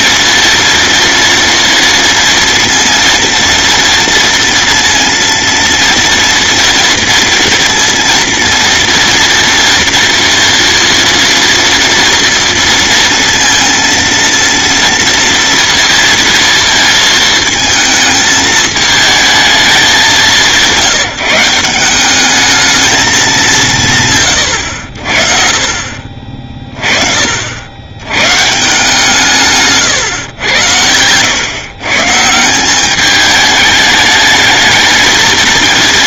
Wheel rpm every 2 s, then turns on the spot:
230, 230, 230, 230, 230, 230, 230, 230, 230, 220, 170, 220, 70, 30, 160, 100, 200, 230.
none